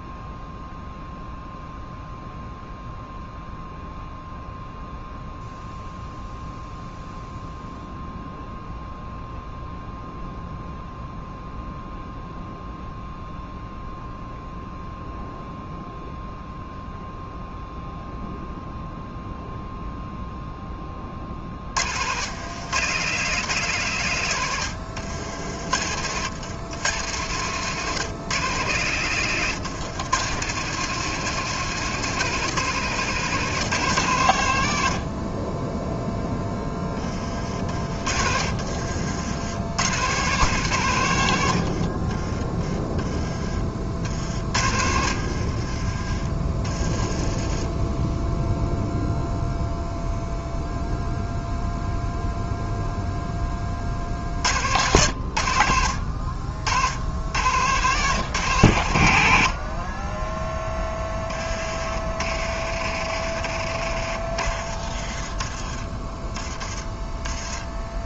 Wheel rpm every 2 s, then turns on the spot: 0, 0, 0, 0, 0, 0, 0, 0, 0, 0, 30, 120, 70, 110, 120, 150, 150, 50, 30, 70, 110, 20, 70, 20, 0, 0, 10, 90, 80, 100, 10, 40, 40, 20.
24-26 42-46